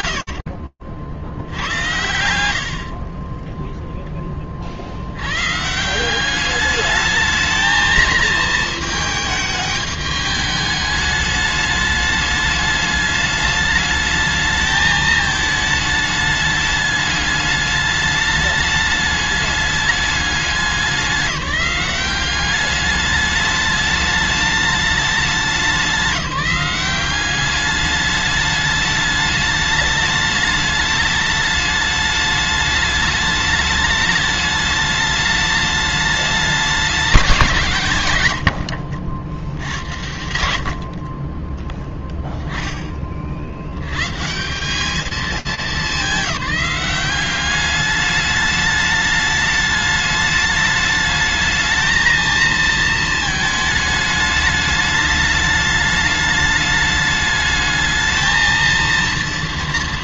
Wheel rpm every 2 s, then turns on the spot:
70, 10, 120, 220, 220, 210, 210, 210, 210, 210, 190, 210, 200, 200, 210, 210, 210, 210, 160, 70, 20, 80, 210, 190, 210, 220, 220, 210, 210, 230.
none